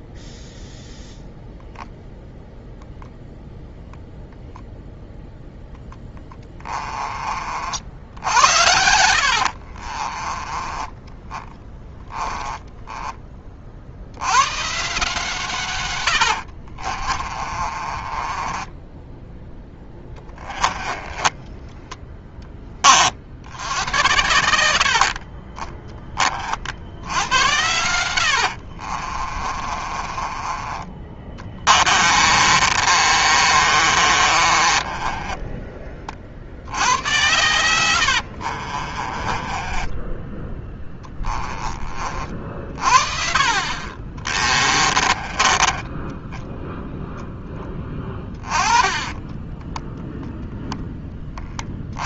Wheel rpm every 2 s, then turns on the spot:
0, 0, 0, 20, 80, 20, 10, 140, 40, 10, 20, 30, 70, 70, 50, 20, 40, 30, 90, 40, 10, 40, 20, 0, 20, 10.
6-14 16-22 28-30 32-36 38-42 44-46 48-50